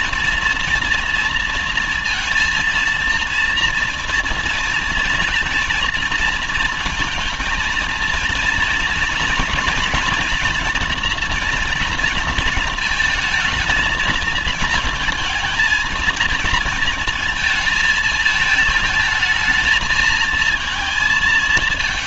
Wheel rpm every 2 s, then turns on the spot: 230, 230, 230, 230, 230, 230, 220, 220, 230, 220, 220.
none